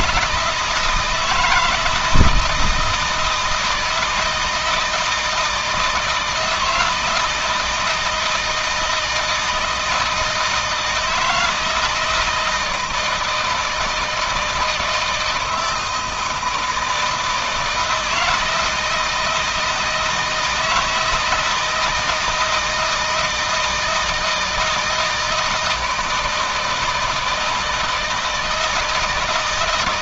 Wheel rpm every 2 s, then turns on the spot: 160, 160, 160, 160, 160, 160, 160, 160, 160, 160, 160, 170, 160, 160, 160.
none